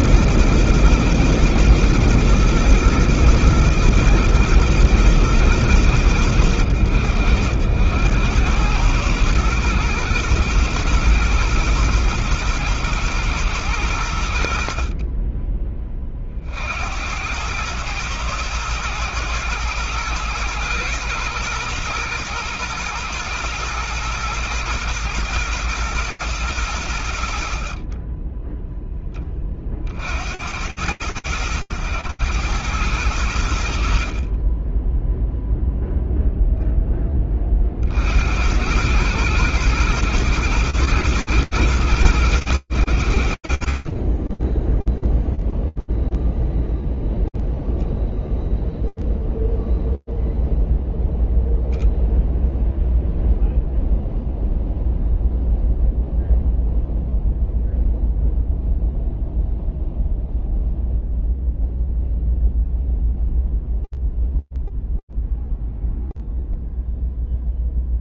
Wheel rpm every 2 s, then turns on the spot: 120, 120, 120, 100, 100, 120, 110, 70, 50, 110, 120, 120, 120, 110, 10, 80, 100, 30, 0, 90, 120, 90, 20, 0, 0, 0, 0, 0, 0, 0, 0, 0, 0, 0.
none